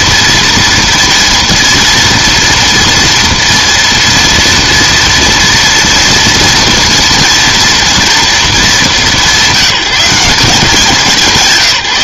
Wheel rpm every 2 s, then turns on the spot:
230, 230, 230, 230, 220, 190.
none